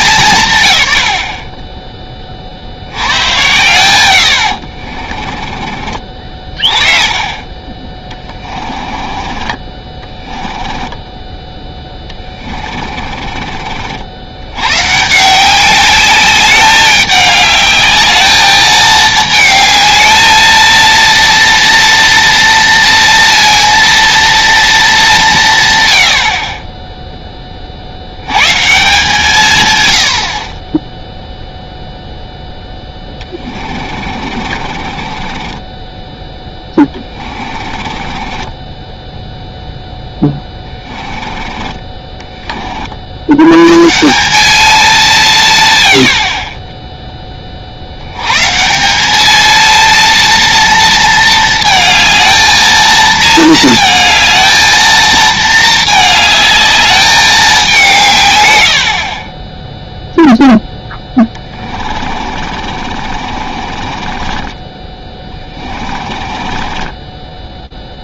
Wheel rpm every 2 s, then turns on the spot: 130, 80, 50, 40, 40, 10, 30, 140, 200, 220, 230, 230, 190, 10, 150, 20, 10, 40, 10, 10, 10, 20, 190, 50, 140, 230, 220, 230, 220, 110, 0, 40, 30, 30.
4-6 8-12 32-42 62-68